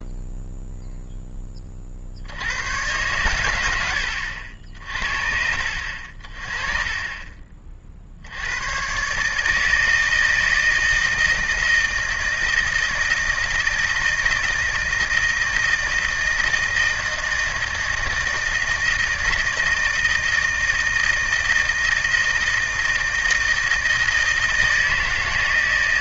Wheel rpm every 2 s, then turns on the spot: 0, 90, 60, 30, 90, 160, 160, 160, 160, 160, 160, 160, 160.
none